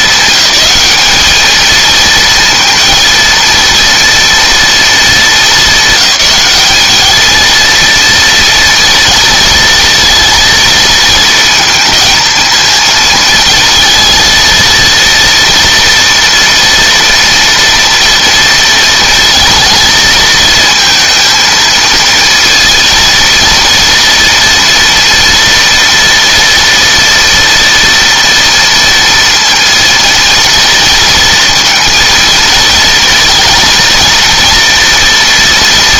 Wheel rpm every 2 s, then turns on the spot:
220, 230, 220, 210, 230, 230, 220, 230, 230, 230, 220, 230, 230, 230, 230, 230, 230, 230.
none